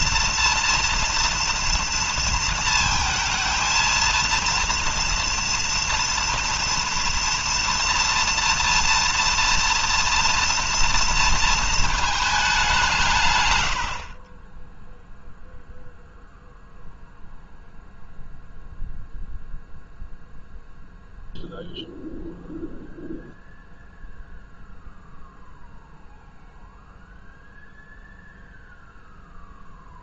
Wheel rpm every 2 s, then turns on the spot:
240, 230, 230, 230, 230, 230, 160, 0, 0, 0, 0, 0, 0, 0, 0.
none